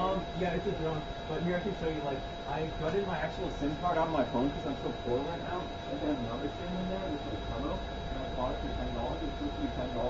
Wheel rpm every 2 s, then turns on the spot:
0, 0, 0, 0, 0.
none